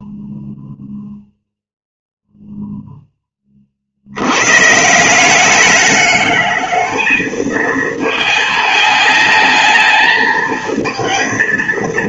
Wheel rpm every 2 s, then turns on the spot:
0, 0, 120, 210, 220, 220.
none